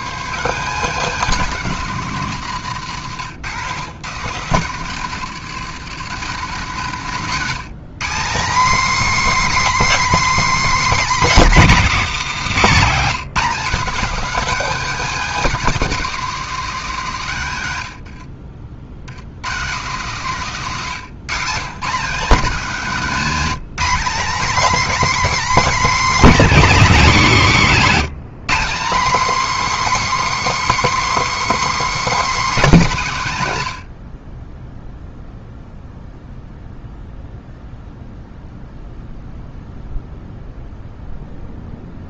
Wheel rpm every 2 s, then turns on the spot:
190, 130, 140, 160, 270, 290, 200, 260, 210, 70, 170, 200, 260, 200, 240, 310, 220, 0, 0, 0, 0.
none